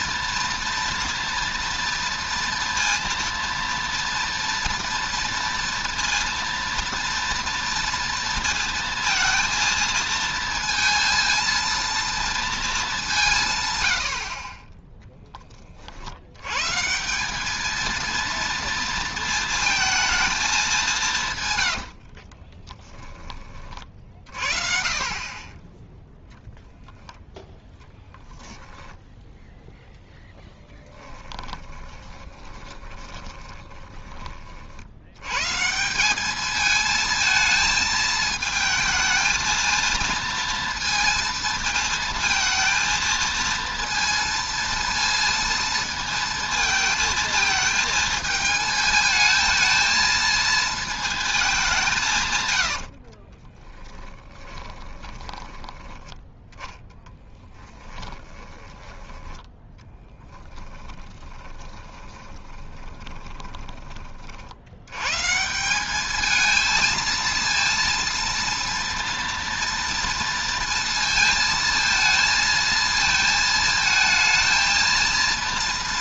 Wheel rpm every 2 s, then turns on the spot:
230, 240, 230, 230, 230, 230, 210, 20, 130, 230, 220, 20, 40, 0, 10, 10, 20, 60, 220, 220, 230, 220, 230, 220, 220, 230, 110, 20, 10, 10, 10, 30, 80, 220, 230, 230, 230, 230.
22-24 30-34 52-56 60-64